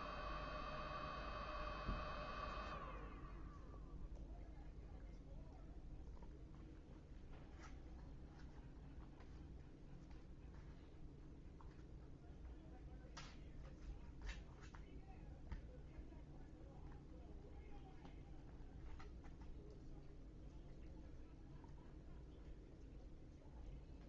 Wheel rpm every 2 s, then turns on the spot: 0, 0, 0, 0, 0, 0, 0, 0, 0, 0, 0, 0.
none